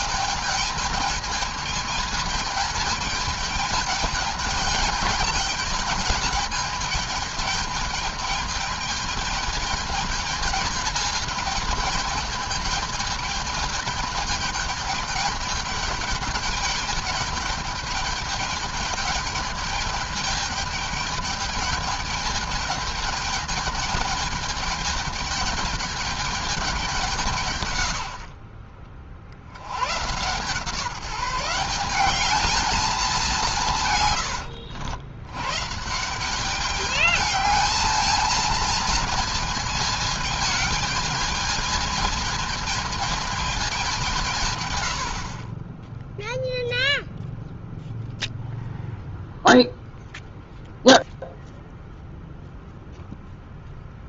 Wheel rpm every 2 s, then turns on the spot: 220, 220, 210, 210, 210, 220, 210, 210, 210, 210, 210, 210, 210, 200, 60, 150, 210, 100, 200, 220, 220, 220, 140, 0, 0, 0, 0.
34-36